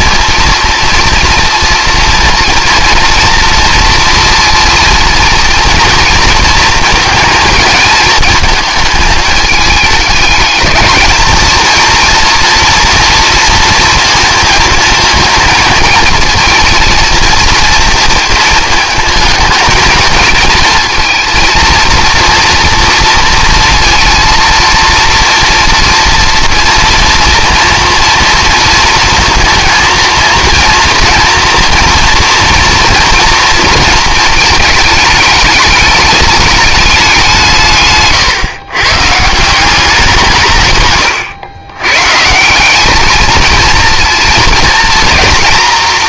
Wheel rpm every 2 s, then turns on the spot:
230, 230, 230, 230, 220, 220, 230, 220, 230, 220, 230, 230, 230, 230, 230, 230, 230, 220, 210, 140, 130, 190, 230.
none